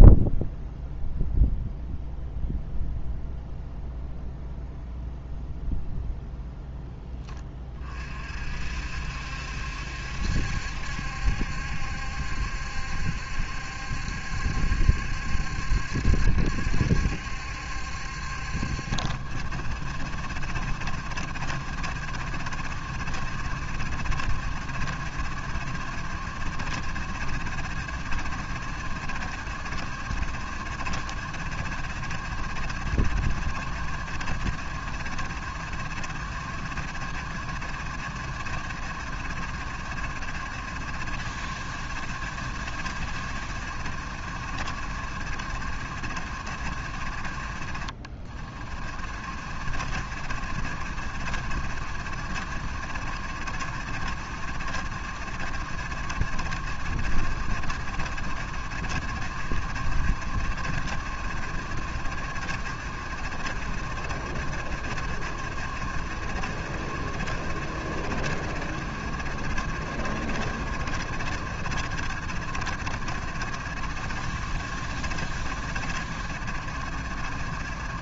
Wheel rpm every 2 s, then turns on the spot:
0, 0, 0, 0, 50, 70, 70, 70, 70, 60, 70, 70, 70, 70, 70, 60, 70, 70, 70, 70, 70, 70, 70, 60, 50, 70, 60, 70, 70, 70, 60, 70, 70, 70, 70, 70, 70, 70, 70.
none